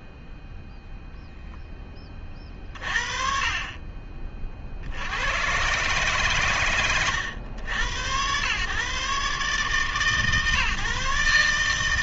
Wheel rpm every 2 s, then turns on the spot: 0, 40, 50, 120, 120, 140.
none